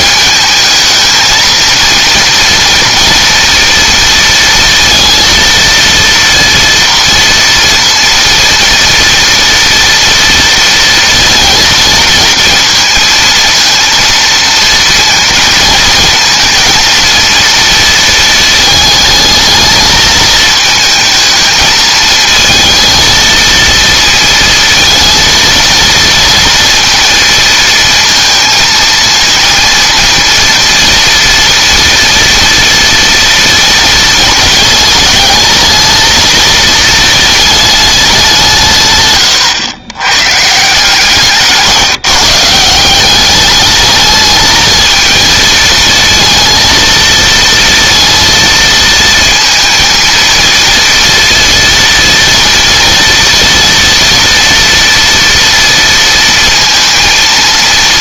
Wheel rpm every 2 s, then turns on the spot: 220, 230, 230, 230, 230, 230, 230, 230, 230, 220, 220, 230, 230, 230, 230, 230, 230, 220, 220, 140, 160, 170, 220, 230, 230, 230, 230, 230, 230.
none